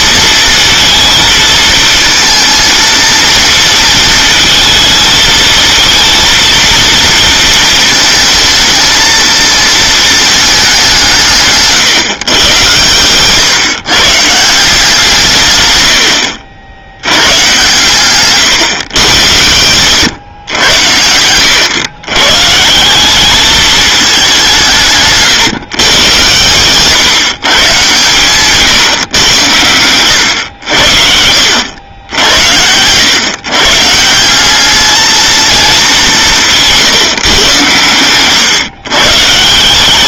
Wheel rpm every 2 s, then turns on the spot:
230, 230, 220, 230, 220, 220, 120, 170, 70, 130, 110, 140, 190, 120, 140, 100, 80, 180, 160, 120.
none